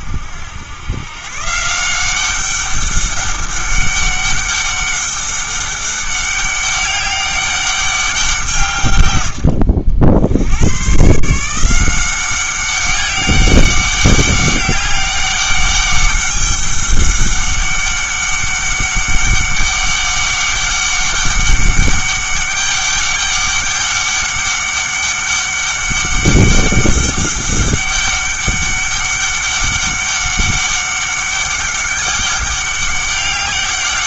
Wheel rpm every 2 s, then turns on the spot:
90, 200, 200, 200, 150, 110, 190, 200, 200, 200, 200, 200, 200, 200, 200, 200, 200.
none